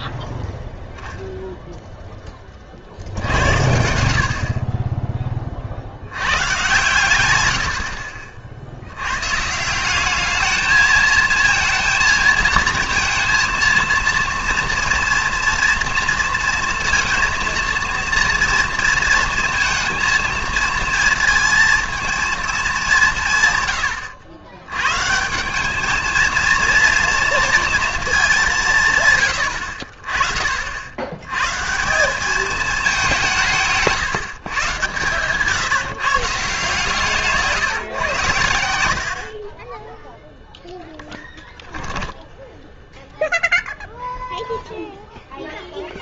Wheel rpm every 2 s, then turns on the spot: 0, 50, 20, 130, 90, 220, 230, 240, 230, 230, 230, 200, 110, 230, 150, 70, 210, 130, 150, 70, 10, 10, 0.
none